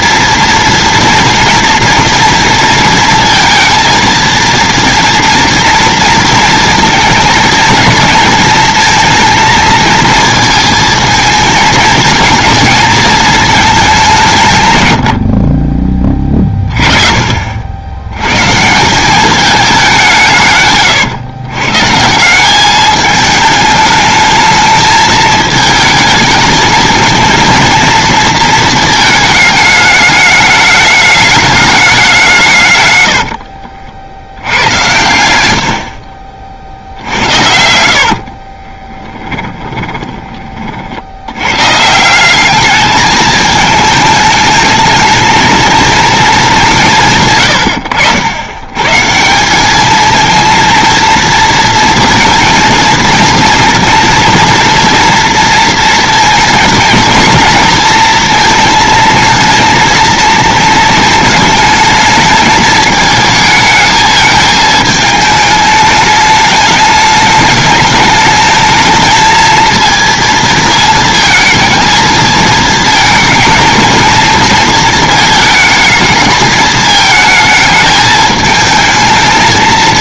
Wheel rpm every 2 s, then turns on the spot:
230, 230, 230, 230, 230, 220, 230, 150, 30, 150, 140, 190, 220, 220, 220, 210, 130, 90, 50, 40, 30, 200, 220, 200, 110, 230, 230, 230, 230, 230, 230, 220, 220, 210, 220, 220, 230, 230, 220, 220.
38-40